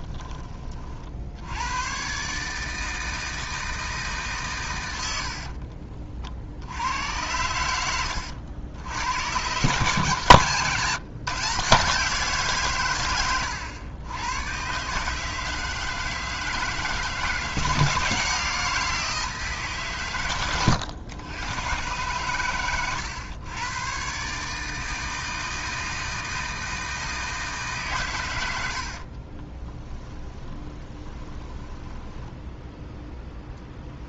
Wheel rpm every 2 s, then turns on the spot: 50, 160, 100, 70, 90, 150, 130, 140, 160, 170, 110, 110, 160, 160, 60, 20, 0.
28-32